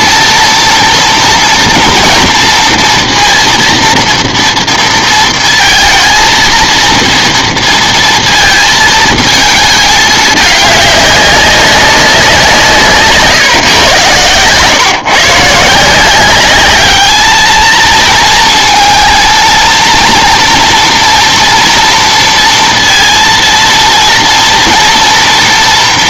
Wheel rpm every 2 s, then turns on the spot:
230, 230, 230, 230, 230, 210, 170, 130, 200, 220, 230, 230, 230.
none